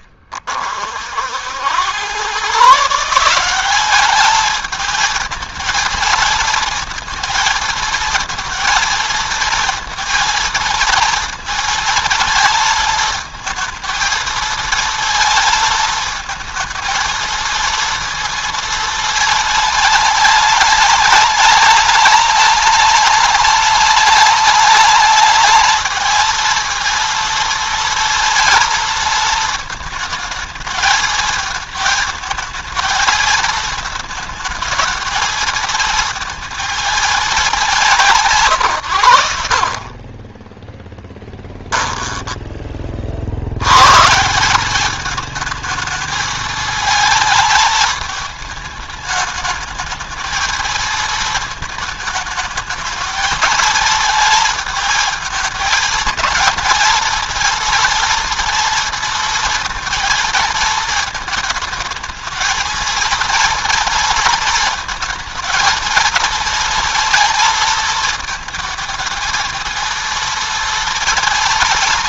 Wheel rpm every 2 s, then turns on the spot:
60, 150, 220, 230, 230, 230, 220, 230, 230, 230, 210, 210, 210, 230, 230, 220, 220, 220, 220, 100, 10, 50, 210, 220, 210, 220, 220, 220, 230, 230, 220, 230, 220, 230, 220, 230.
40-42